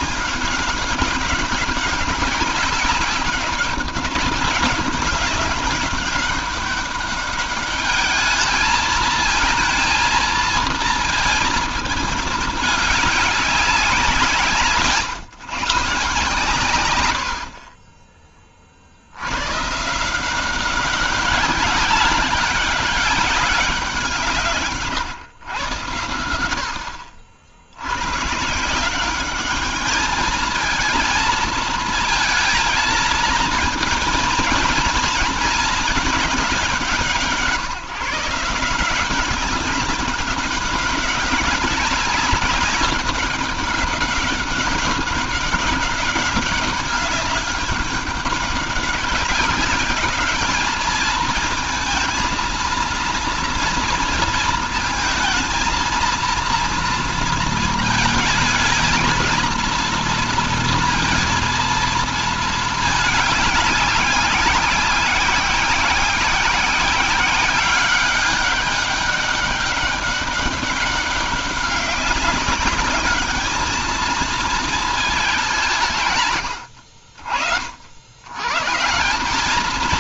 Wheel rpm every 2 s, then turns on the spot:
200, 200, 200, 200, 220, 230, 210, 150, 100, 50, 190, 200, 150, 70, 170, 220, 230, 230, 190, 170, 190, 200, 200, 200, 200, 210, 230, 230, 230, 220, 230, 220, 190, 190, 200, 200, 200, 220, 80, 150.
none